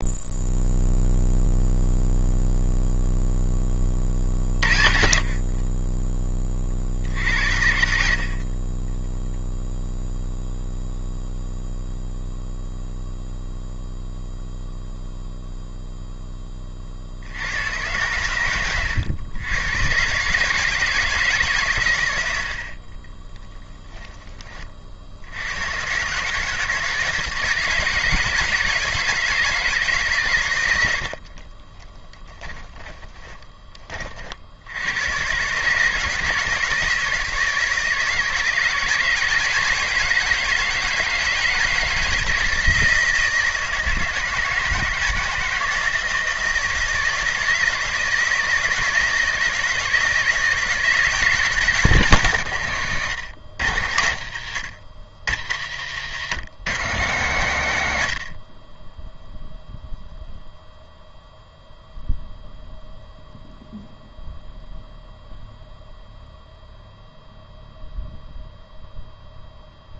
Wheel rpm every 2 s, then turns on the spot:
0, 0, 50, 50, 20, 0, 0, 0, 30, 110, 160, 70, 40, 150, 160, 100, 10, 80, 160, 150, 160, 160, 160, 160, 160, 160, 150, 100, 150, 30, 0, 0, 0, 0, 0.
22-24 32-34